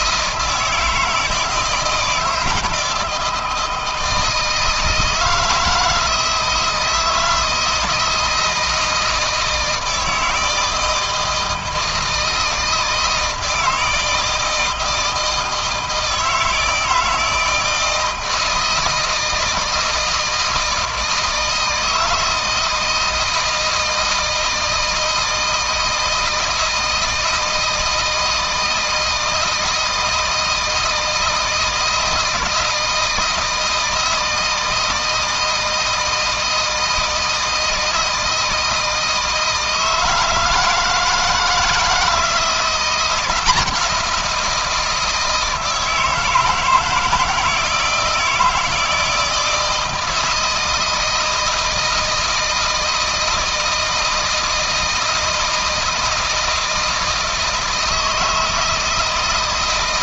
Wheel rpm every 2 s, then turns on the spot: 160, 160, 160, 160, 170, 160, 160, 160, 160, 160, 160, 160, 160, 160, 160, 160, 160, 160, 160, 160, 160, 170, 170, 160, 160, 170, 160, 160, 160, 160.
none